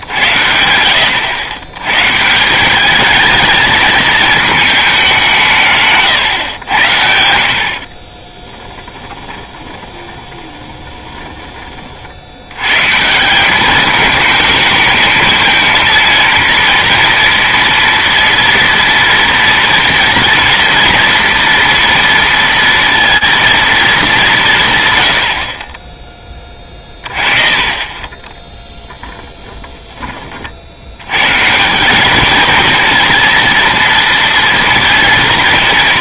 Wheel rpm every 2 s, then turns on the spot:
80, 190, 210, 90, 10, 20, 120, 220, 230, 230, 240, 230, 150, 30, 10, 90, 230, 230.
8-12 26-28